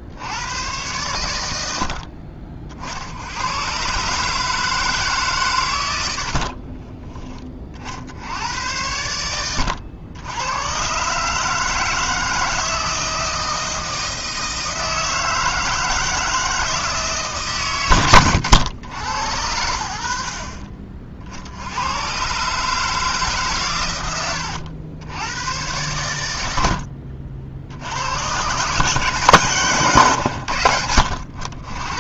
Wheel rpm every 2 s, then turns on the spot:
100, 60, 150, 20, 90, 120, 160, 160, 160, 100, 50, 150, 80, 60, 140, 90.
6-8